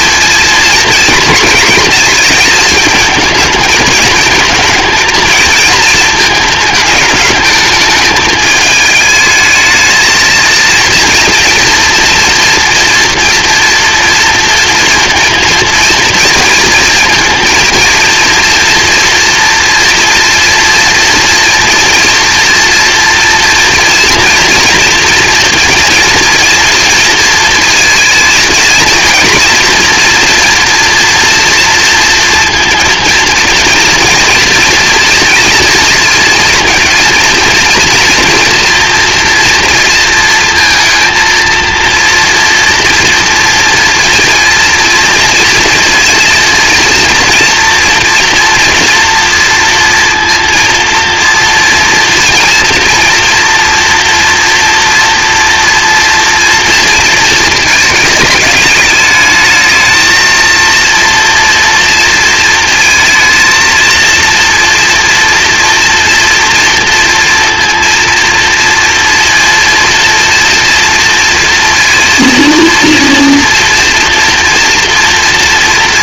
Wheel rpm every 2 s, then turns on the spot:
230, 230, 230, 220, 220, 230, 230, 230, 230, 230, 230, 230, 240, 230, 230, 240, 230, 230, 230, 230, 230, 230, 230, 230, 230, 230, 230, 230, 230, 210, 230, 230, 240, 230, 230, 230, 230, 230.
none